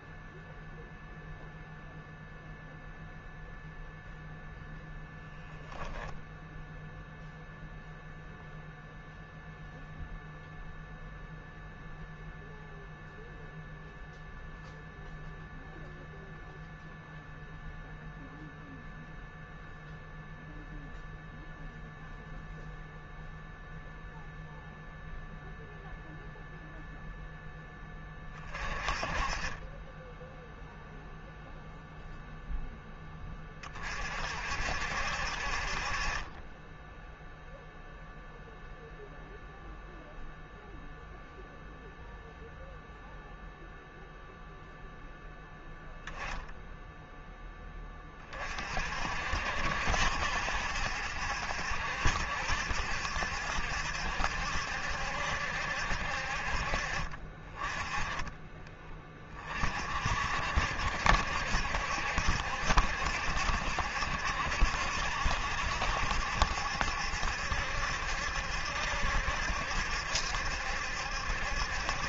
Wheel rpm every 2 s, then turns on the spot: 0, 0, 0, 0, 0, 0, 0, 0, 0, 0, 0, 0, 0, 0, 30, 0, 0, 60, 10, 0, 0, 0, 0, 0, 40, 70, 70, 70, 50, 20, 60, 70, 70, 70, 70, 70.
none